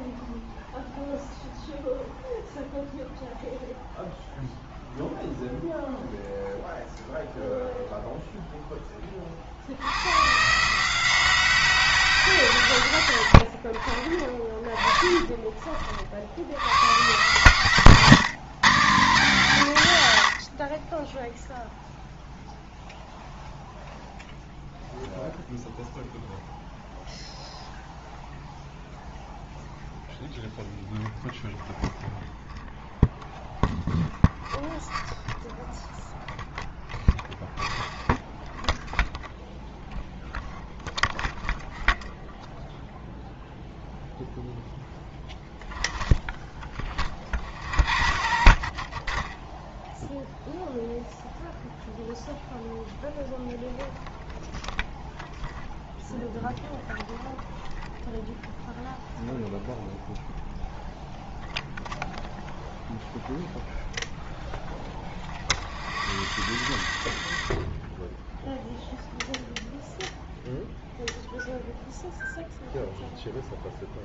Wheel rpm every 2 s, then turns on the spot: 0, 0, 0, 0, 0, 150, 130, 20, 90, 150, 40, 0, 0, 0, 0, 0, 0, 0, 0, 0, 0, 0, 0, 10, 40, 0, 0, 0, 0, 0, 0, 0, 0, 0, 0, 0, 0.
none